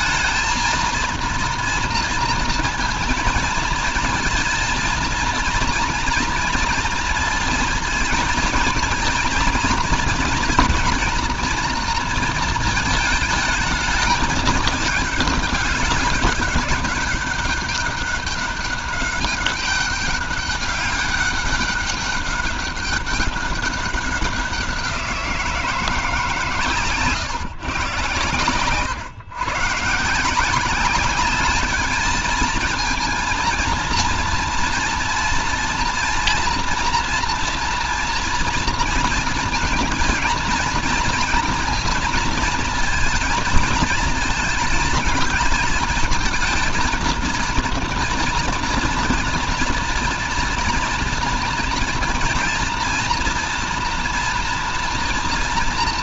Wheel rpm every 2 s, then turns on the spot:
230, 230, 230, 230, 230, 230, 220, 210, 200, 200, 200, 200, 180, 140, 120, 190, 230, 230, 240, 230, 230, 230, 220, 230, 230, 230, 230, 230.
none